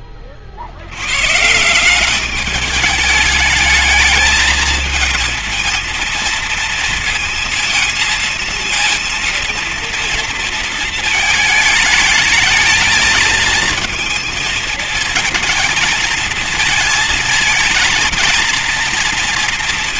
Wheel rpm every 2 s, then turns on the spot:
70, 210, 220, 230, 230, 230, 220, 220, 220, 230.
none